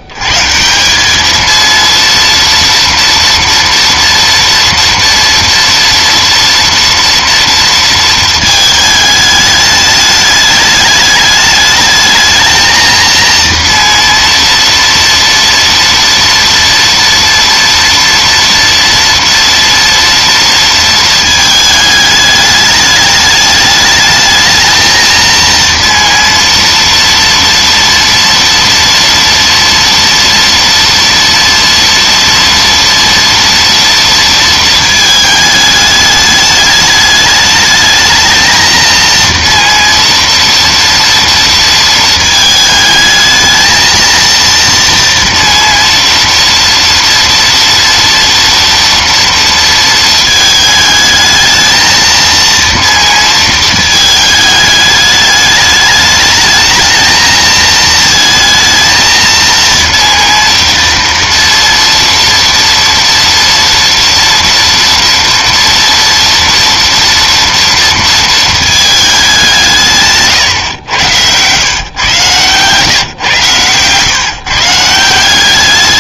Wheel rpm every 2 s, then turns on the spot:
90, 230, 230, 230, 220, 210, 220, 230, 230, 230, 230, 210, 220, 230, 240, 230, 230, 220, 210, 230, 230, 220, 230, 240, 230, 220, 230, 210, 220, 230, 230, 230, 230, 230, 220, 130, 120, 150.
70-72